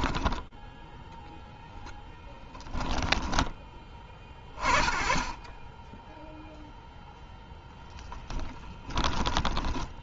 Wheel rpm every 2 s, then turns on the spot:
10, 10, 30, 0, 10.
2-4 8-10